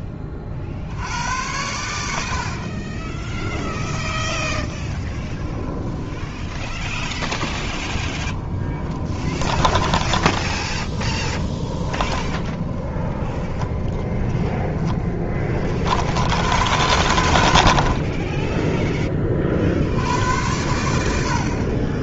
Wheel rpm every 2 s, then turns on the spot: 50, 40, 10, 10, 20, 10, 20, 20, 80, 10, 90.
2-16